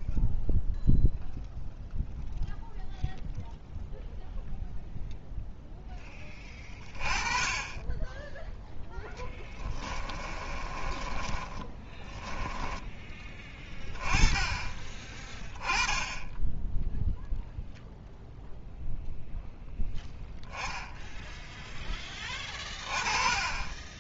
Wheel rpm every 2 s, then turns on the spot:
0, 0, 0, 30, 10, 30, 10, 20, 10, 0, 10, 20.
10-12